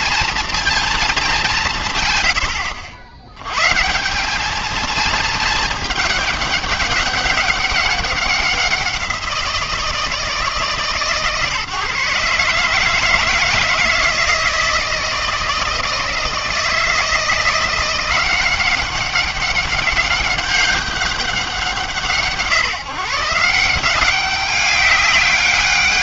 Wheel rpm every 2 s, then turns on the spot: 230, 100, 210, 210, 190, 150, 150, 160, 160, 180, 200, 150, 200.
none